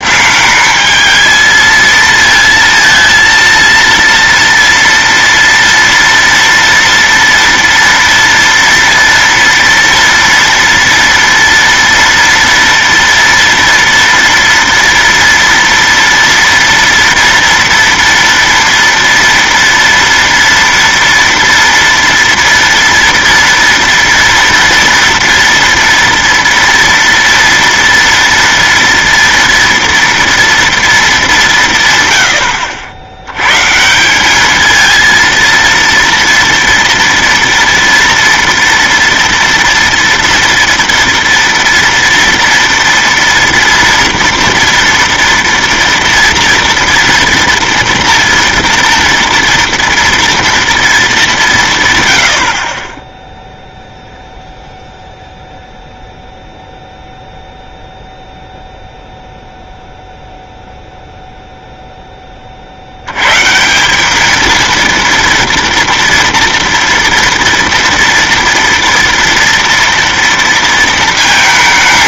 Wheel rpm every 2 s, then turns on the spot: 200, 230, 230, 230, 230, 230, 230, 230, 230, 230, 230, 230, 230, 230, 230, 230, 80, 210, 230, 230, 230, 230, 230, 240, 230, 230, 50, 0, 0, 0, 0, 40, 230, 230, 230, 230.
none